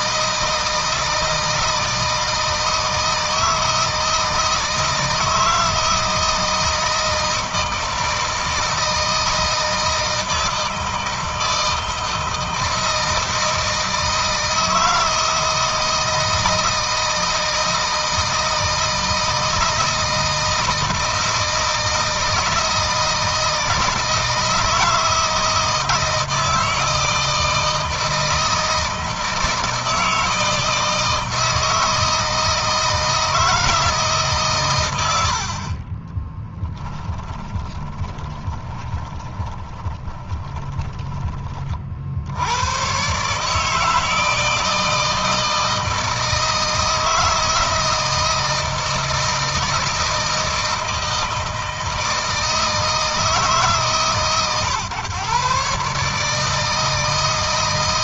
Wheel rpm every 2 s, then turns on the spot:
160, 160, 160, 160, 160, 160, 160, 160, 160, 160, 160, 160, 160, 160, 160, 160, 160, 120, 20, 20, 20, 120, 160, 160, 160, 160, 160, 140, 160.
36-42